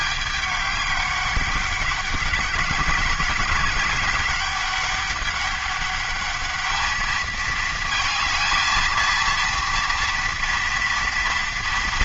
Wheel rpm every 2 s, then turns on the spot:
200, 190, 200, 210, 230, 240.
none